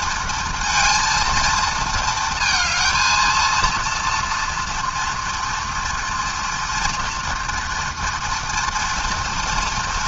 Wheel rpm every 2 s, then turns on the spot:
230, 230, 230, 230, 240.
none